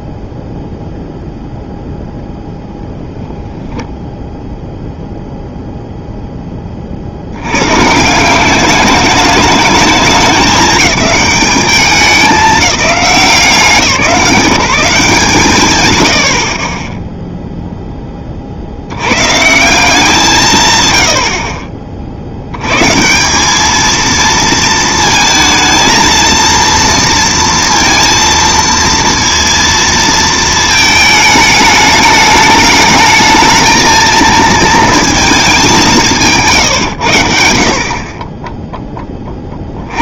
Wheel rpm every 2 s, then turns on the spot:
0, 10, 0, 70, 210, 210, 180, 160, 0, 100, 90, 170, 220, 230, 230, 220, 220, 220, 90, 40.
none